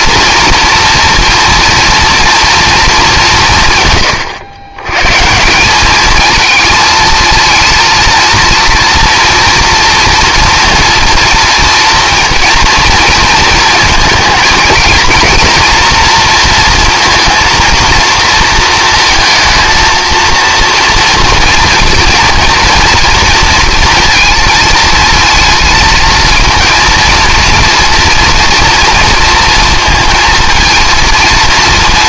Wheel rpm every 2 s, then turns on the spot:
230, 220, 110, 230, 230, 230, 230, 230, 230, 230, 230, 230, 230, 230, 240, 230.
none